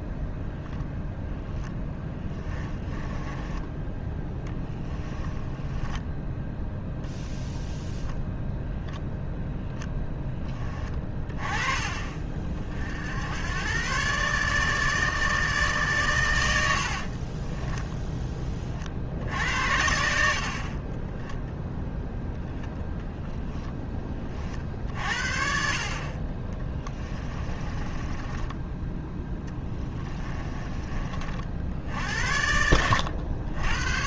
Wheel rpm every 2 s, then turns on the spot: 0, 20, 10, 0, 0, 20, 60, 150, 60, 40, 30, 10, 50, 20, 20, 30, 80.
2-6 16-18 22-24 26-28